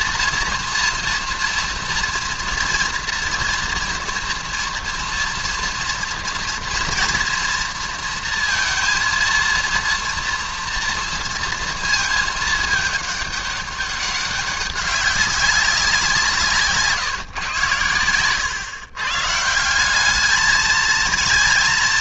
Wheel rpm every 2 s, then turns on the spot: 240, 240, 230, 230, 230, 230, 210, 200, 150, 120, 220.
none